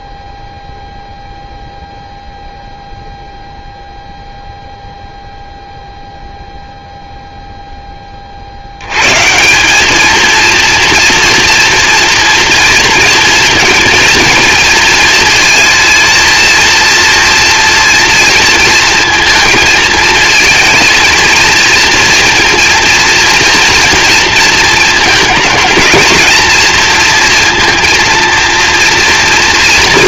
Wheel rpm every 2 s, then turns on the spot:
0, 0, 0, 0, 110, 240, 230, 220, 230, 230, 230, 230, 230, 230, 230.
none